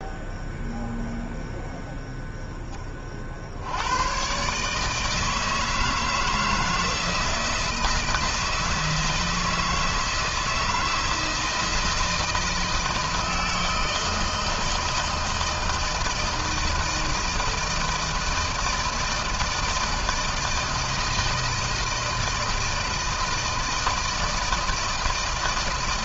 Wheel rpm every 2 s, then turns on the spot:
0, 10, 130, 160, 160, 160, 160, 160, 160, 160, 160, 160, 160.
none